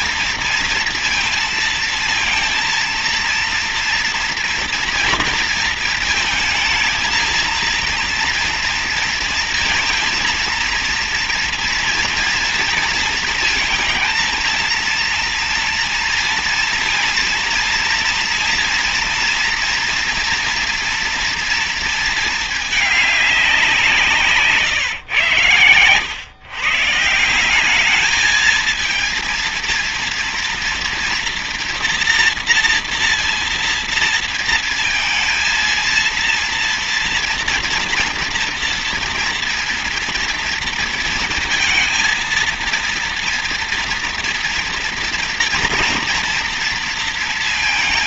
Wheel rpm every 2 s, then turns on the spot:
230, 230, 240, 220, 230, 230, 230, 230, 230, 230, 230, 220, 160, 150, 220, 230, 230, 230, 230, 230, 230, 230, 240, 230.
none